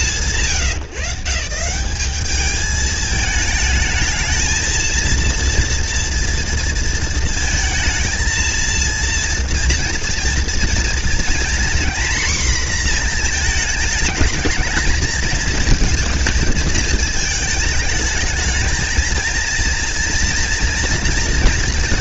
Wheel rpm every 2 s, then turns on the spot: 140, 210, 230, 230, 230, 230, 230, 220, 220, 220, 230.
none